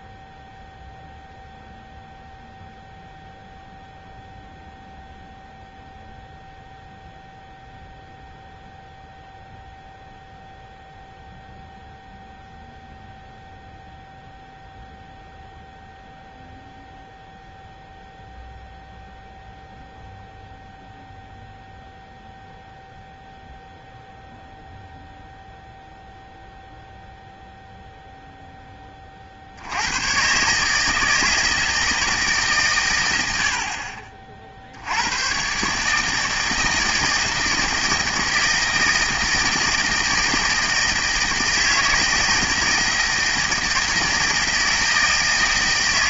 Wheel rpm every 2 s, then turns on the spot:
0, 0, 0, 0, 0, 0, 0, 0, 0, 0, 0, 0, 0, 0, 10, 140, 130, 60, 160, 160, 160, 160, 160.
none